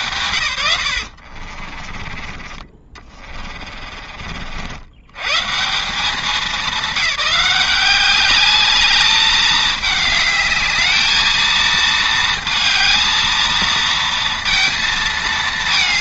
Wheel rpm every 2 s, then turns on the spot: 110, 30, 70, 190, 210, 210, 230, 230.
2-4